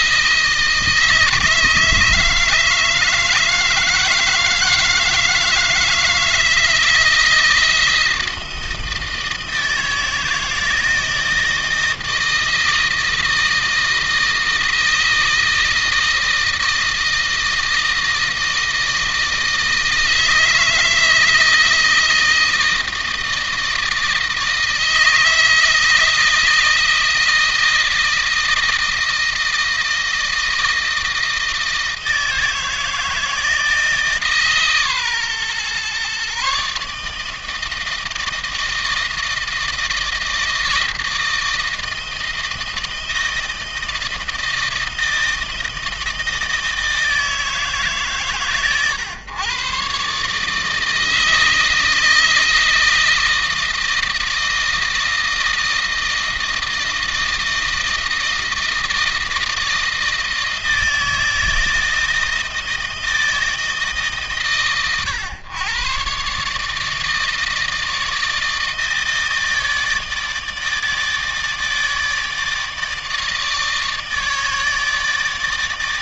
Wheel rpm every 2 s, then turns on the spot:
160, 160, 160, 160, 160, 160, 160, 160, 160, 160, 160, 160, 160, 160, 160, 160, 160, 140, 150, 160, 160, 160, 160, 160, 120, 160, 160, 160, 160, 160, 160, 160, 130, 150, 160, 150, 160, 150.
none